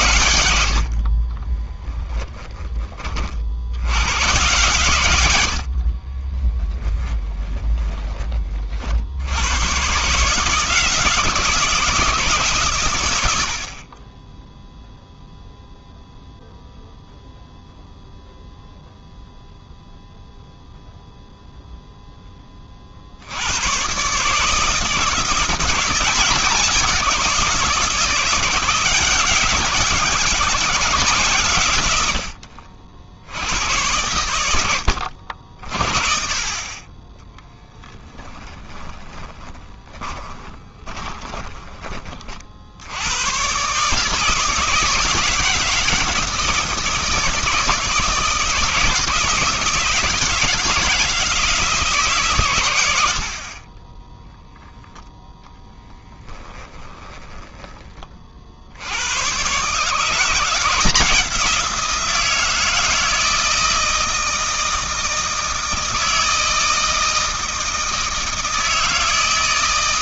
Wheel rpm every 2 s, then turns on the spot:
80, 20, 120, 10, 30, 160, 140, 0, 0, 0, 0, 30, 160, 170, 170, 170, 60, 80, 30, 10, 20, 60, 160, 160, 160, 170, 110, 0, 10, 70, 170, 170, 160, 160, 160.
6-8 38-42 56-58